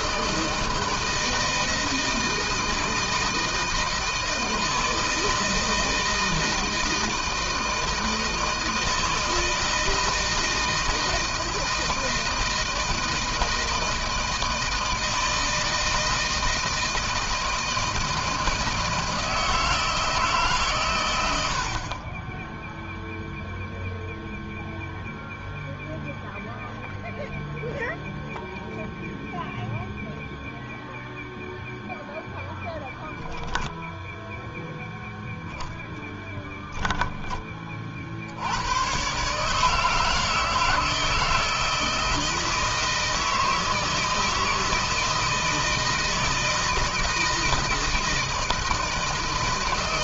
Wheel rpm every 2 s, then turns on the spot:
160, 160, 160, 160, 160, 160, 160, 160, 160, 160, 120, 0, 0, 0, 0, 0, 0, 0, 10, 110, 160, 160, 160, 160, 160.
none